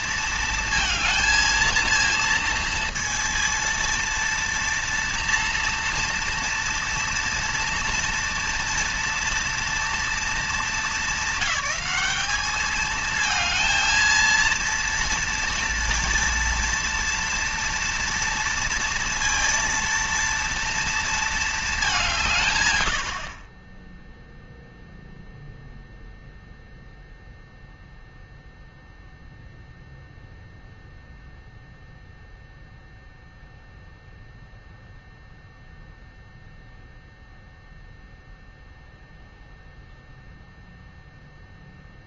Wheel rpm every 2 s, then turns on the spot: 230, 230, 230, 230, 230, 220, 220, 230, 230, 230, 230, 100, 0, 0, 0, 0, 0, 0, 0, 0, 0.
none